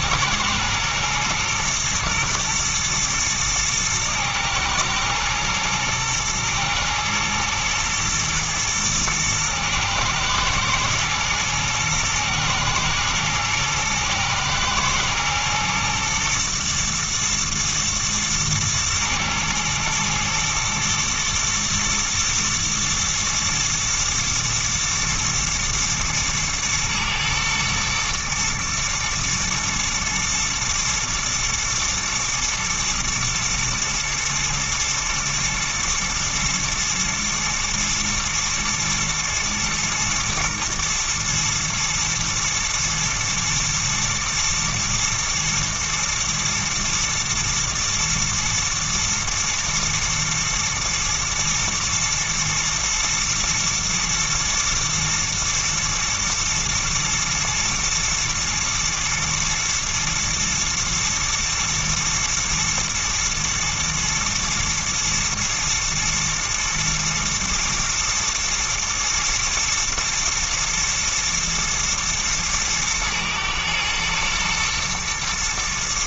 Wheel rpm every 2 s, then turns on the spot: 110, 120, 110, 120, 120, 110, 110, 120, 120, 110, 110, 120, 110, 120, 120, 120, 110, 110, 120, 110, 120, 110, 110, 110, 120, 110, 120, 110, 110, 120, 110, 120, 120, 110, 110, 110, 110, 110.
none